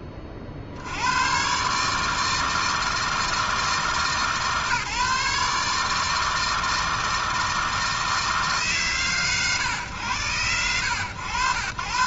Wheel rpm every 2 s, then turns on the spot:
80, 160, 150, 160, 140, 100.
none